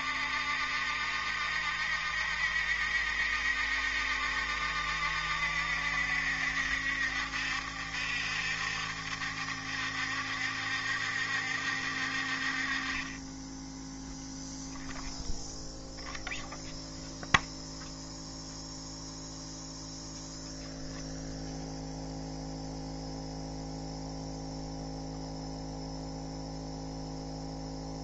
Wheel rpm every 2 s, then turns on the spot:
70, 70, 70, 70, 70, 70, 40, 0, 0, 0, 0, 0, 0, 0.
none